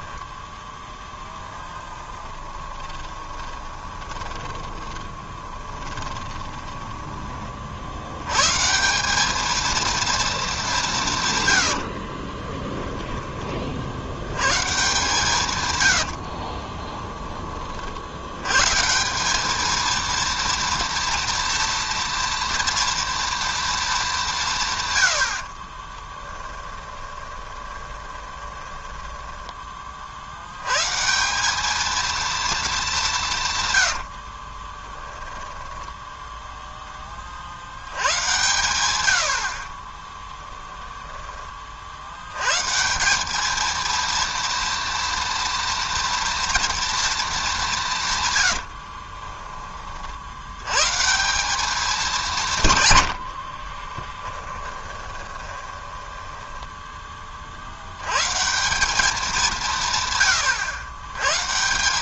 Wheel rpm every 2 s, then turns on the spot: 10, 20, 20, 10, 150, 190, 10, 140, 20, 150, 230, 230, 130, 20, 20, 140, 210, 20, 10, 110, 0, 140, 230, 230, 70, 120, 140, 20, 10, 190, 110.
0-8 12-14 16-18 26-30 34-36 48-50 54-56